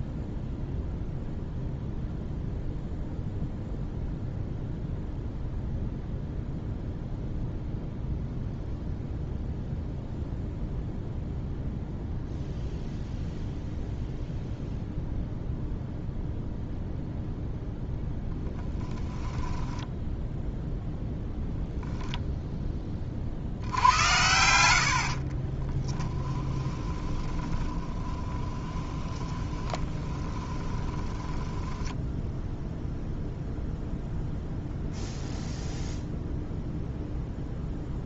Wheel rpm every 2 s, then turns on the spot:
0, 0, 0, 0, 0, 0, 0, 0, 0, 10, 0, 10, 80, 30, 20, 20, 0, 0, 0.
18-20 26-32